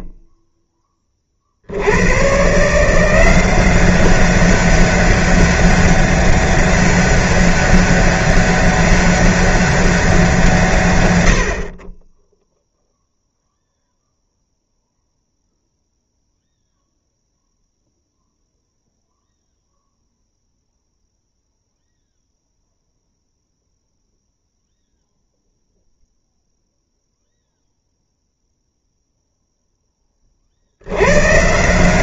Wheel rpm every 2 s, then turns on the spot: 10, 160, 190, 200, 200, 150, 0, 0, 0, 0, 0, 0, 0, 0, 0, 70.
none